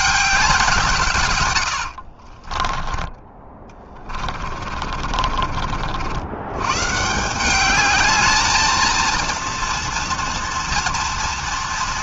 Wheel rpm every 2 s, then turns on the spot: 130, 10, 40, 180, 230, 230.
4-6